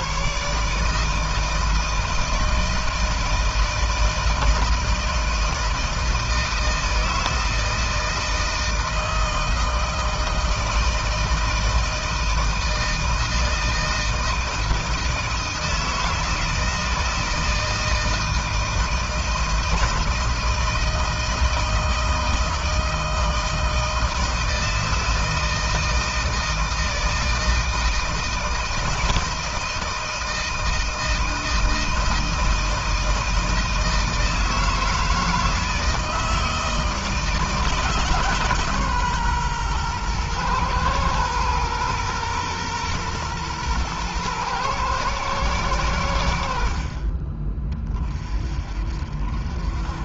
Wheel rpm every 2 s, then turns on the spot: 140, 160, 160, 160, 160, 160, 160, 160, 160, 160, 160, 160, 160, 160, 160, 160, 160, 160, 160, 140, 120, 120, 120, 60, 40.
none